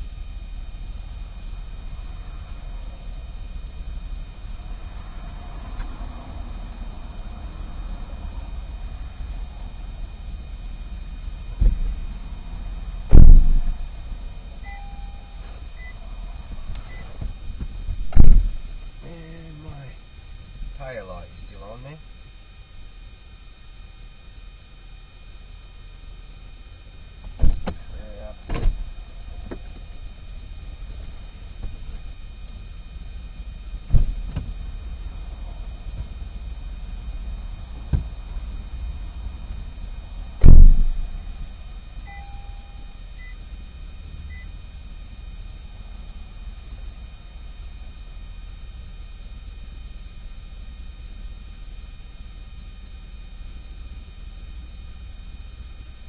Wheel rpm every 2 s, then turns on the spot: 0, 0, 0, 0, 0, 0, 0, 0, 0, 0, 0, 0, 0, 0, 0, 0, 0, 0, 0, 0, 0, 0, 0, 0, 0, 0, 0, 0.
none